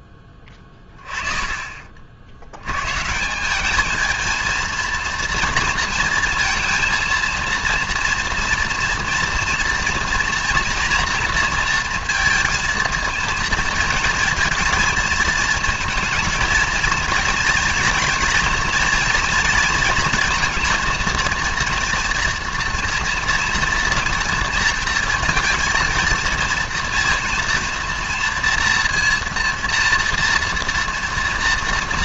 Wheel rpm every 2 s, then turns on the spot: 20, 100, 230, 230, 230, 240, 230, 230, 230, 230, 230, 240, 230, 230, 230, 230.
none